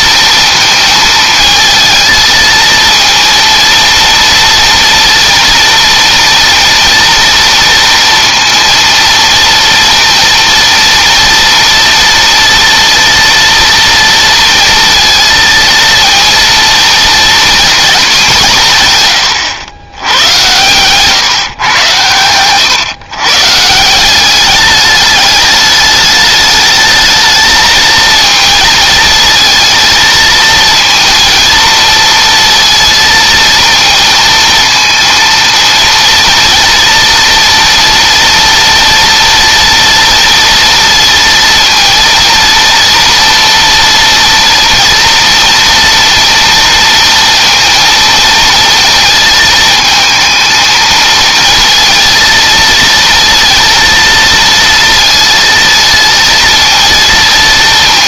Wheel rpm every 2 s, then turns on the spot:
230, 230, 230, 230, 230, 240, 230, 230, 230, 150, 130, 130, 210, 220, 220, 230, 230, 230, 240, 240, 230, 230, 230, 230, 220, 230, 230, 230, 230.
none